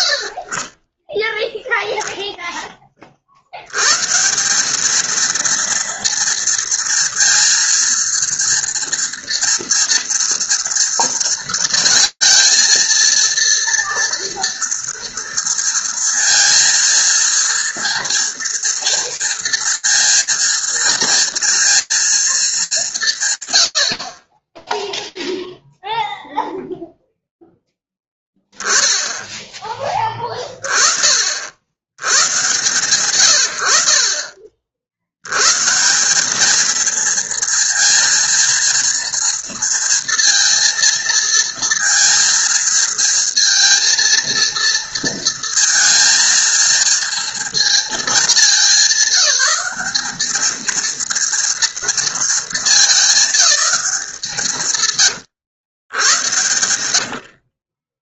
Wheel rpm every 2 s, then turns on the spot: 90, 10, 190, 230, 230, 230, 230, 230, 230, 230, 230, 190, 0, 0, 10, 40, 120, 80, 230, 230, 230, 230, 230, 230, 190, 230, 220, 130, 80.
56-58